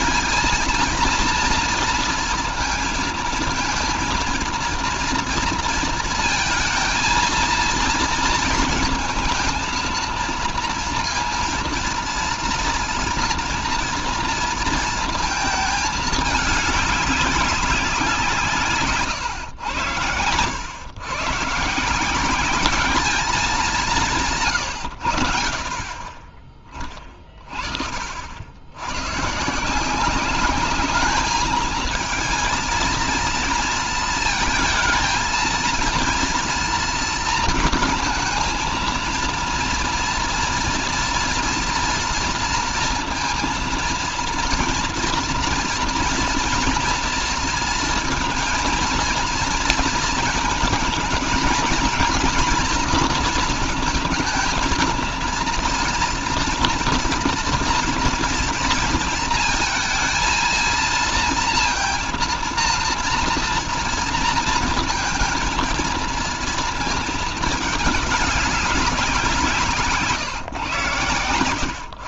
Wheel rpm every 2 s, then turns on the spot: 240, 230, 230, 230, 230, 230, 230, 230, 210, 130, 120, 210, 100, 30, 90, 200, 230, 220, 230, 230, 230, 230, 230, 230, 230, 230, 230, 230, 230, 230, 230, 230, 230, 220, 200, 120.
none